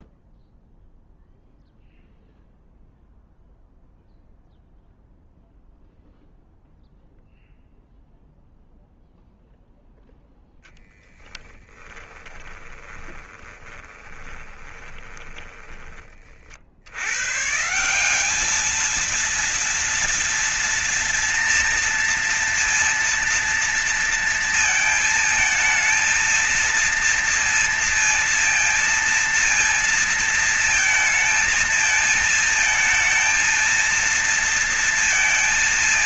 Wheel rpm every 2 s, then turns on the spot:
0, 0, 0, 0, 0, 10, 20, 30, 80, 220, 230, 230, 230, 230, 230, 230, 220, 230.
12-16